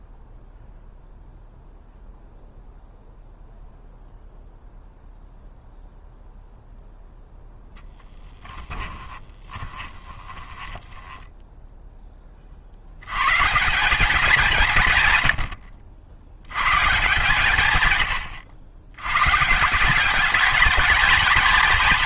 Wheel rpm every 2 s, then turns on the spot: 0, 0, 0, 0, 10, 20, 40, 180, 110, 80, 210.
8-12